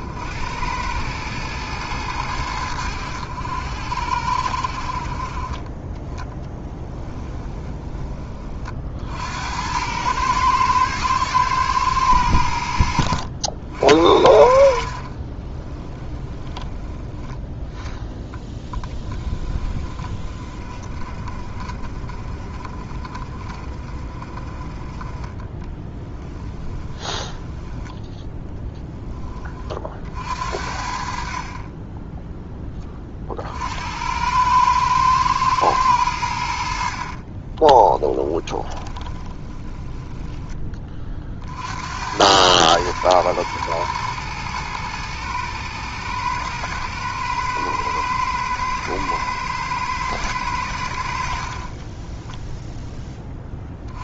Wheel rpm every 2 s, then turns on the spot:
100, 80, 50, 10, 60, 110, 70, 50, 20, 20, 40, 30, 30, 20, 20, 50, 30, 110, 50, 20, 30, 110, 110, 110, 110, 70, 10.
6-8 14-16 26-28 36-40